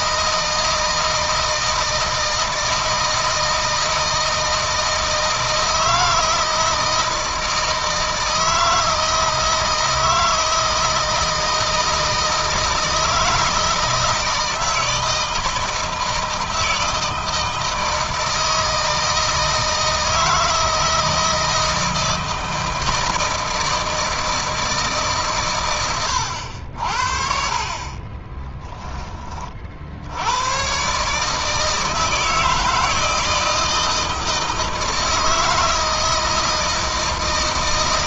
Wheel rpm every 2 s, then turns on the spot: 160, 160, 160, 160, 160, 160, 160, 160, 160, 160, 160, 160, 150, 70, 20, 130, 160, 160, 160.
none